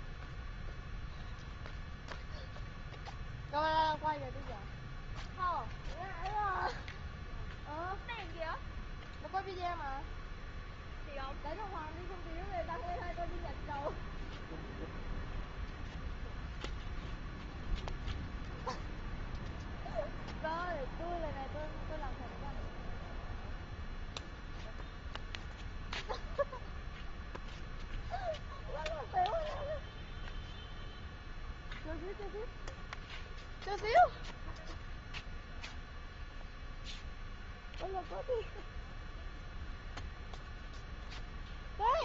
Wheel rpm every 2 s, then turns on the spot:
0, 0, 0, 0, 0, 0, 0, 0, 0, 0, 0, 0, 0, 0, 0, 0, 0, 0, 0, 0, 0.
none